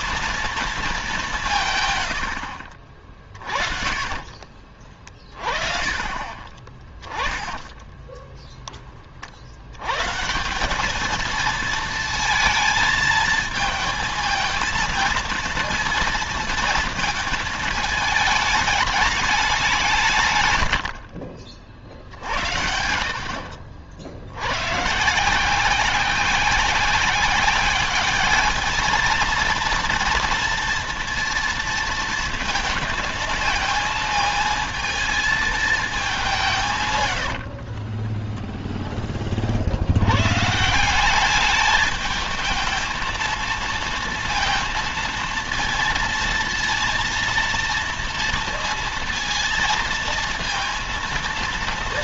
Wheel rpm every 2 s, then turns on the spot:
220, 40, 30, 20, 10, 190, 230, 230, 230, 210, 110, 60, 120, 190, 210, 230, 230, 220, 150, 10, 150, 220, 230, 230, 230, 230.
6-8 20-22 36-38